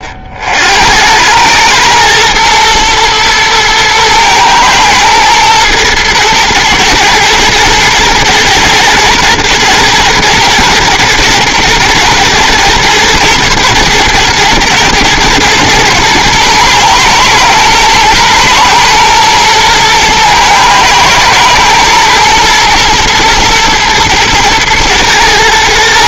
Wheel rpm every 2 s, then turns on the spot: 70, 110, 120, 110, 110, 120, 110, 110, 120, 120, 110, 120, 110.
none